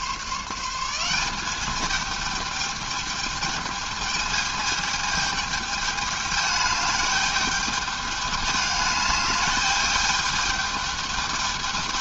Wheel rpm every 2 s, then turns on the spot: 170, 210, 210, 210, 210, 210.
none